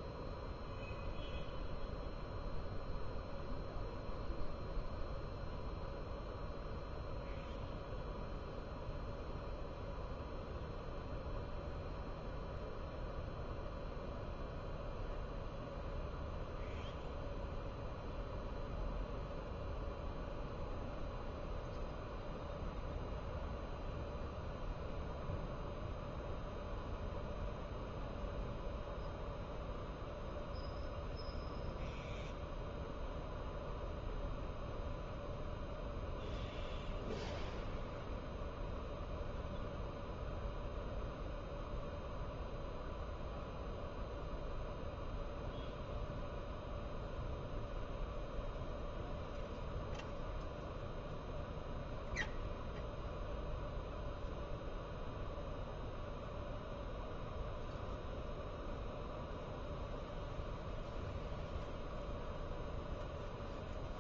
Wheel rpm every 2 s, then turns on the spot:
0, 0, 0, 0, 0, 0, 0, 0, 0, 0, 0, 0, 0, 0, 0, 0, 0, 0, 0, 0, 0, 0, 0, 0, 0, 0, 0, 0, 0, 0, 0, 0.
none